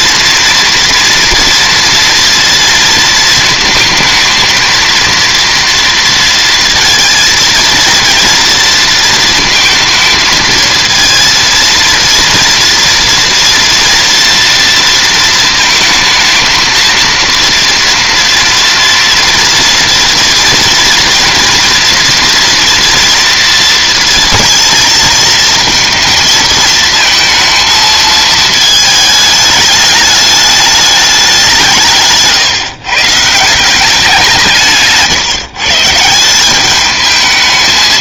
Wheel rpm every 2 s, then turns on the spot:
230, 230, 230, 230, 230, 230, 230, 230, 230, 230, 230, 230, 230, 220, 220, 210, 140, 150, 210.
none